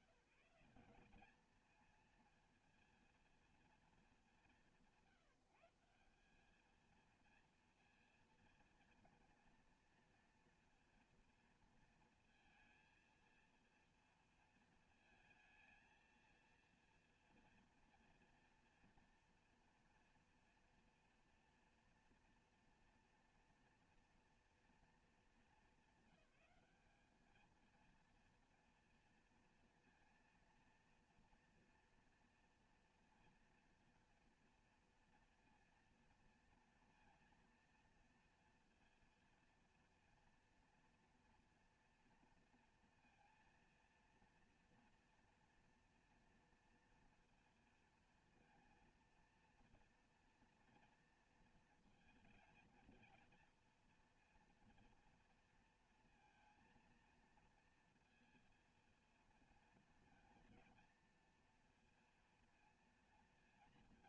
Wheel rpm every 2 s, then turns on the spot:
190, 230, 190, 210, 230, 230, 230, 220, 230, 240, 230, 230, 240, 200, 230, 230, 240, 230, 230, 230, 240, 240, 230, 230, 230, 230, 230, 230, 230, 230, 230, 230.
none